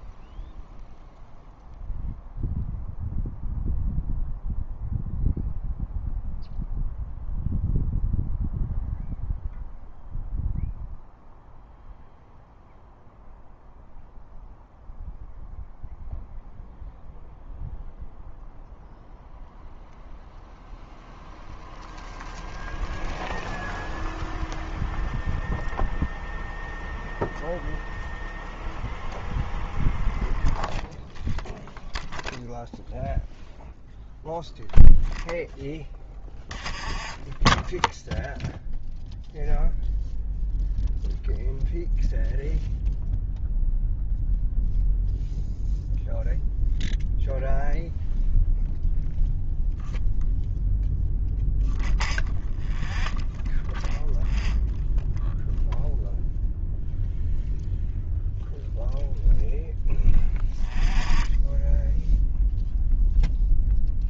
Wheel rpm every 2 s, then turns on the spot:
0, 0, 0, 0, 0, 0, 0, 0, 0, 0, 0, 0, 0, 0, 0, 0, 0, 0, 0, 0, 0, 0, 0, 0, 0, 0, 0, 0, 0, 0, 0, 0.
none